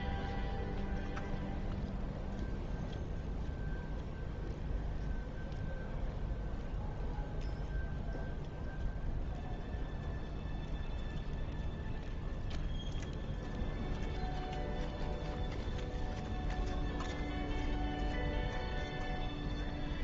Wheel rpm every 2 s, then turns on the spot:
0, 0, 0, 0, 0, 0, 0, 0, 0, 0.
none